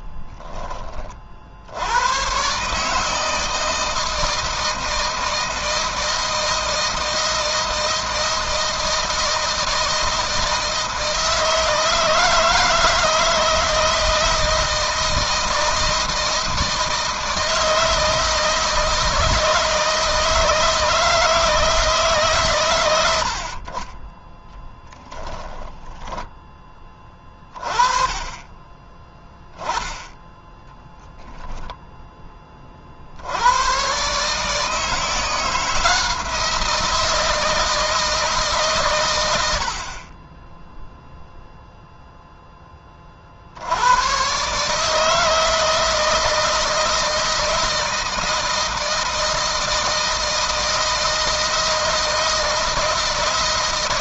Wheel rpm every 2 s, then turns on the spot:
20, 140, 160, 160, 160, 160, 160, 160, 160, 160, 160, 110, 10, 20, 10, 0, 40, 160, 170, 140, 10, 20, 150, 160, 160, 160, 160.
none